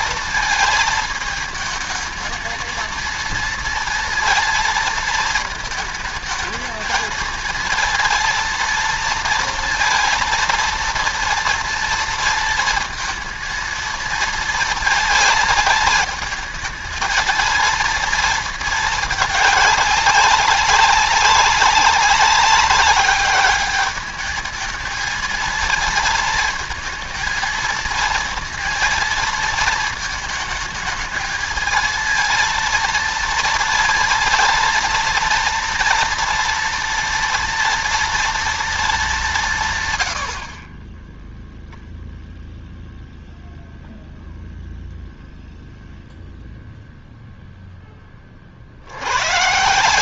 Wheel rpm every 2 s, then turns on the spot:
220, 220, 230, 220, 230, 230, 230, 220, 220, 220, 190, 200, 220, 220, 230, 220, 230, 230, 230, 220, 30, 0, 0, 0, 70.
none